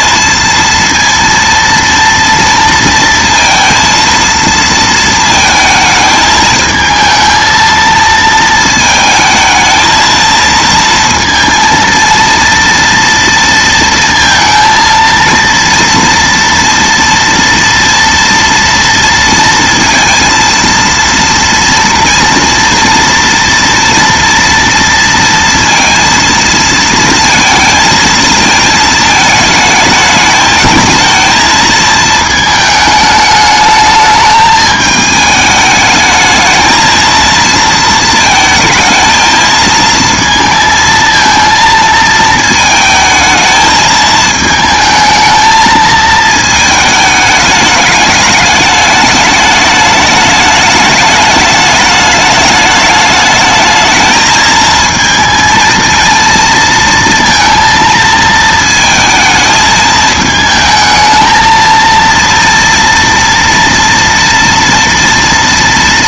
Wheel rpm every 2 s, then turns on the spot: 230, 230, 230, 220, 220, 230, 230, 230, 230, 230, 230, 230, 230, 230, 220, 220, 220, 220, 220, 220, 230, 220, 220, 220, 210, 210, 210, 220, 230, 220, 220, 230, 240.
none